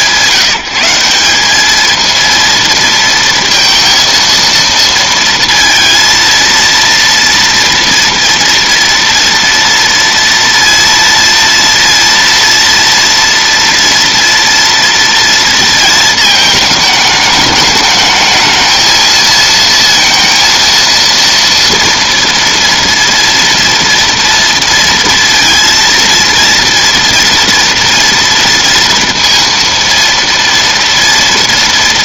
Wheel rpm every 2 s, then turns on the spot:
170, 230, 230, 230, 230, 230, 230, 230, 220, 220, 230, 230, 230, 230, 230, 230.
none